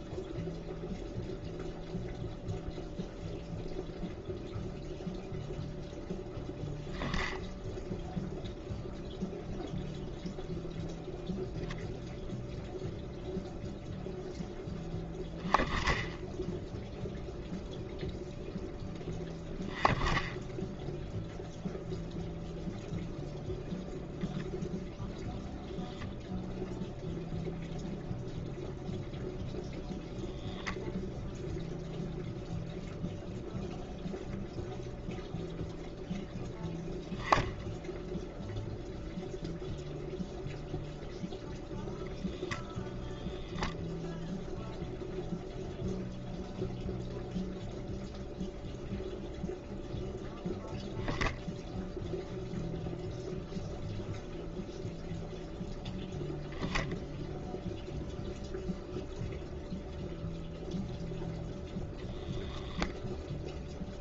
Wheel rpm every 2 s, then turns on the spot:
0, 0, 0, 0, 0, 0, 0, 0, 0, 0, 0, 0, 0, 0, 0, 0, 0, 0, 0, 0, 0, 0, 0, 0, 0, 0, 0, 0, 0, 0, 0, 0.
none